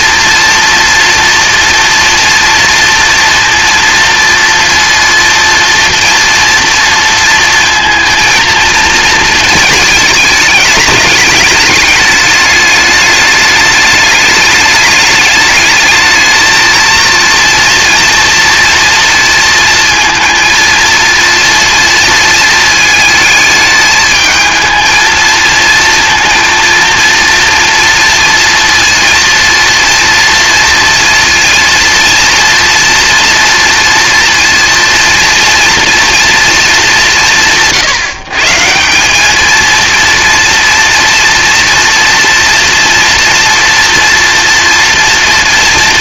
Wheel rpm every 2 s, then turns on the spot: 240, 230, 230, 230, 230, 210, 210, 210, 220, 230, 230, 220, 220, 230, 230, 230, 230, 230, 210, 170, 230, 230, 230.
none